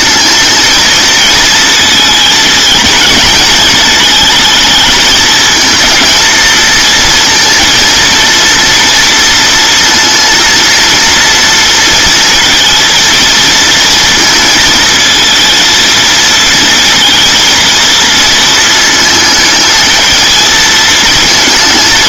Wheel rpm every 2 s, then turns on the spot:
220, 220, 220, 230, 230, 230, 230, 220, 230, 220, 230.
none